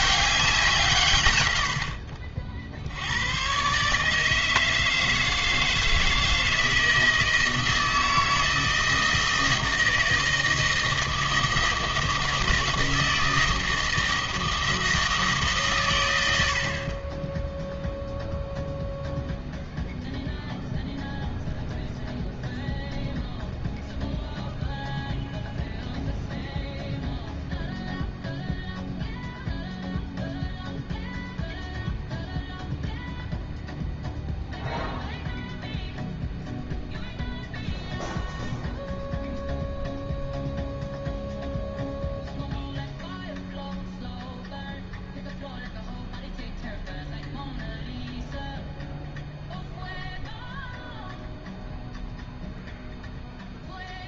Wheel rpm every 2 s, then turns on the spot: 190, 70, 160, 160, 160, 160, 160, 160, 70, 0, 0, 0, 0, 0, 0, 0, 0, 0, 0, 0, 0, 0, 0, 0, 0, 0, 0.
none